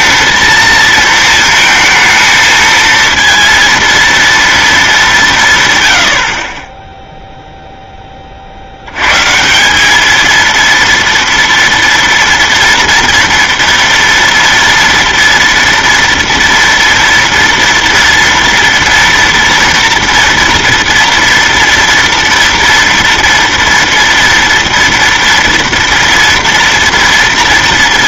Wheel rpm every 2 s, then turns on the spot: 230, 220, 230, 60, 50, 230, 240, 230, 230, 230, 230, 230, 230, 230.
none